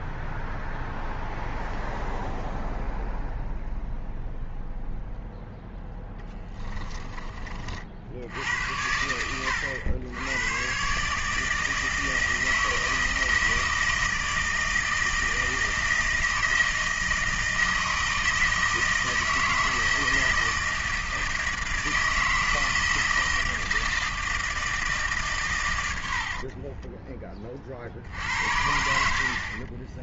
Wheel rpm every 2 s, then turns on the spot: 0, 0, 0, 20, 80, 120, 160, 160, 160, 160, 160, 160, 160, 40, 70.
6-8 26-28